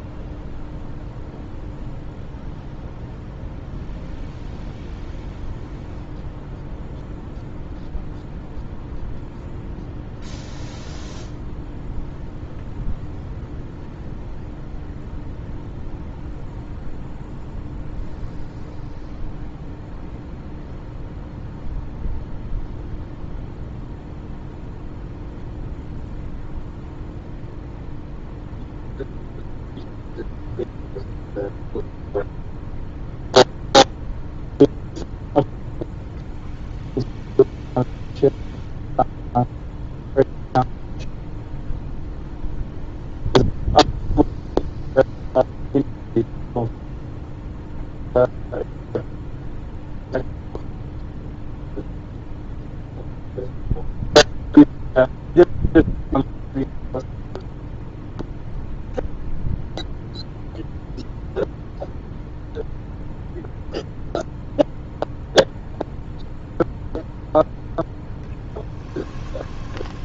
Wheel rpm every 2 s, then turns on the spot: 0, 0, 0, 0, 0, 0, 0, 0, 0, 0, 0, 0, 0, 0, 0, 0, 0, 0, 0, 0, 0, 0, 0, 0, 0, 0, 0, 0, 0, 0, 0, 0, 0, 0, 10.
68-70